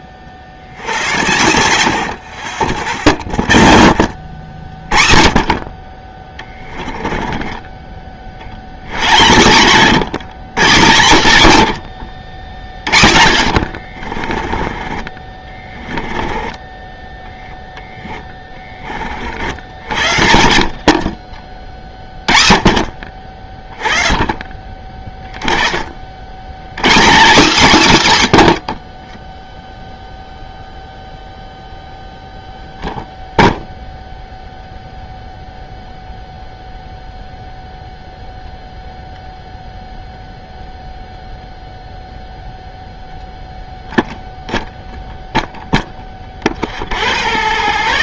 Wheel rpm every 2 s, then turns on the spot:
60, 80, 40, 20, 50, 150, 80, 40, 10, 10, 80, 40, 20, 70, 150, 0, 0, 0, 0, 0, 0, 0, 0, 20.
2-4 6-8 12-16